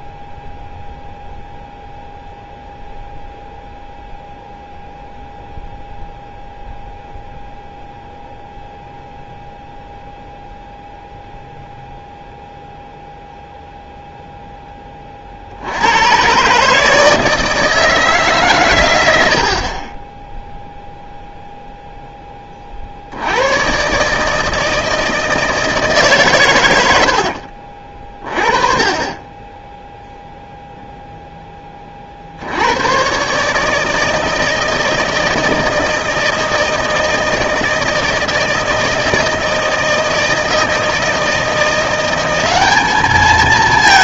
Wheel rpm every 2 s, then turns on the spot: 0, 0, 0, 0, 0, 0, 0, 10, 140, 120, 0, 40, 160, 100, 30, 0, 90, 160, 160, 160, 160, 200.
none